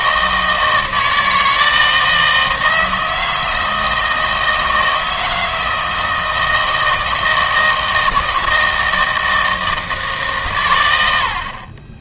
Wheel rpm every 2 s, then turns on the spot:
160, 160, 160, 160, 160, 110.
none